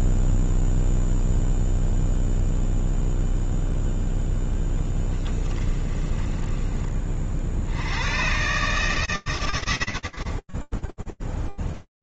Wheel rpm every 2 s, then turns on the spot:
0, 0, 10, 20, 150, 10.
4-6